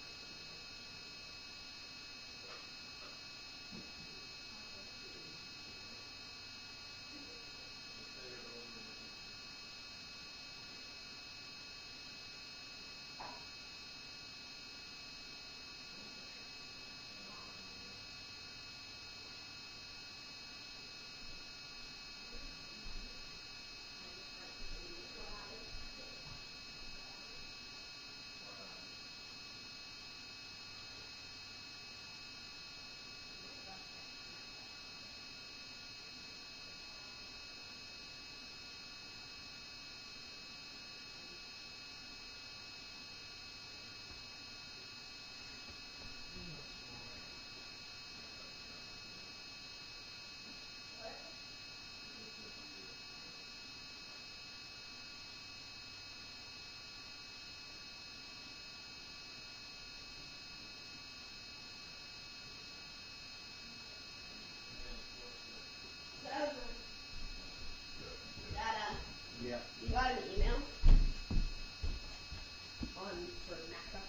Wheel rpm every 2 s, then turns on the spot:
0, 0, 0, 0, 0, 0, 0, 0, 0, 0, 0, 0, 0, 0, 0, 0, 0, 0, 0, 0, 0, 0, 0, 0, 0, 0, 0, 0, 0, 0, 0, 0, 0, 0, 0, 0, 0.
none